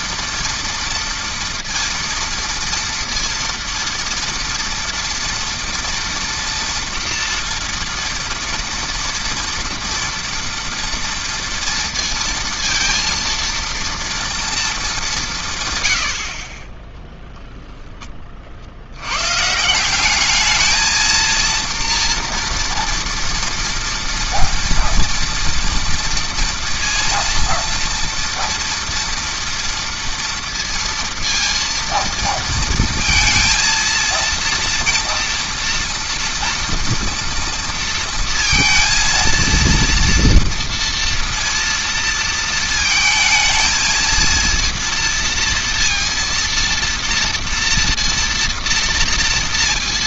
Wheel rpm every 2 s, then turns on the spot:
230, 230, 230, 240, 230, 230, 230, 220, 10, 80, 220, 230, 240, 230, 230, 230, 230, 230, 230, 230, 230, 220, 230, 230, 230.
none